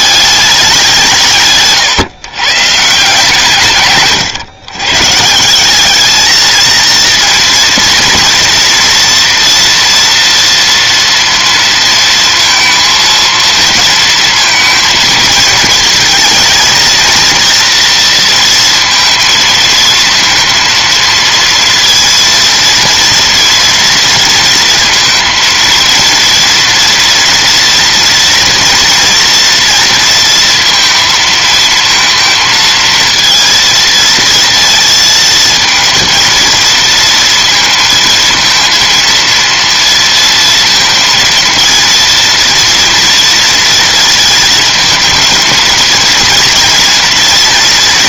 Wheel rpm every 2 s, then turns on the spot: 190, 140, 130, 230, 230, 230, 230, 220, 230, 230, 230, 230, 230, 230, 230, 230, 220, 230, 230, 230, 230, 230, 220, 230.
none